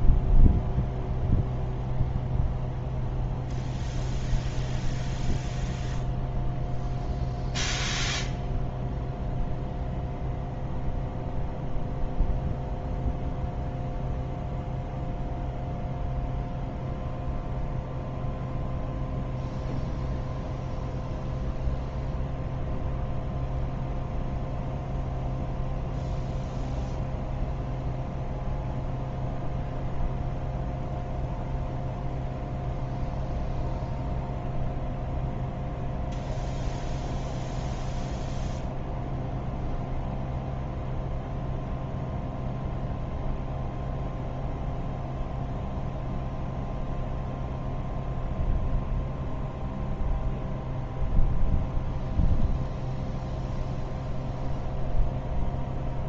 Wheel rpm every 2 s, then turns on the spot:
0, 0, 0, 0, 0, 0, 0, 0, 0, 0, 0, 0, 0, 0, 0, 0, 0, 0, 0, 0, 0, 0, 0, 0, 0, 0, 0, 0.
none